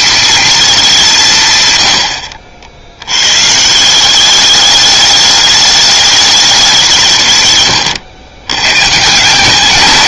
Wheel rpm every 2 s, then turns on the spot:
210, 60, 200, 190, 110.
none